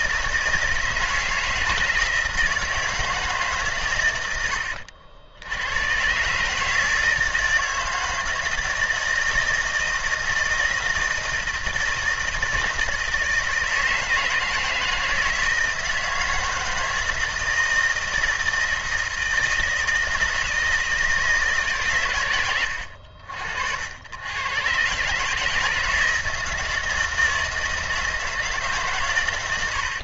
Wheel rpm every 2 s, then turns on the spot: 160, 160, 70, 160, 160, 160, 160, 160, 160, 160, 160, 80, 130, 160, 140.
none